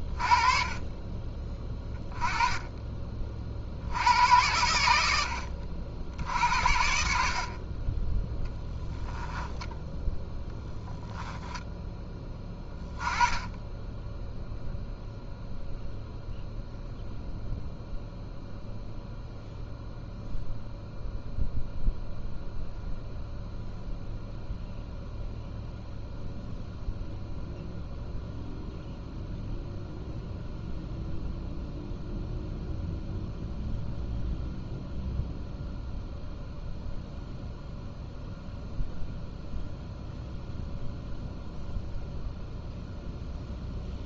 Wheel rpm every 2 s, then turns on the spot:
30, 20, 90, 70, 10, 10, 20, 0, 0, 0, 0, 0, 0, 0, 0, 0, 0, 0, 0, 0, 0, 0.
8-10